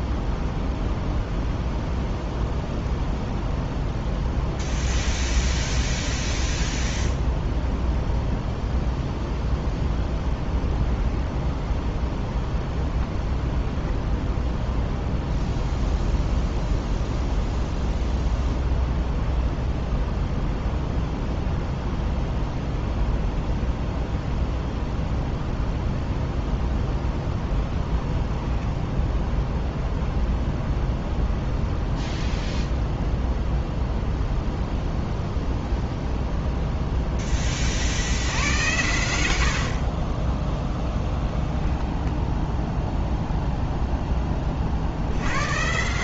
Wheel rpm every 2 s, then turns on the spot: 0, 0, 0, 0, 0, 20, 0, 0, 0, 0, 0, 0, 0, 0, 0, 0, 0, 0, 0, 90, 10, 10, 50.
40-44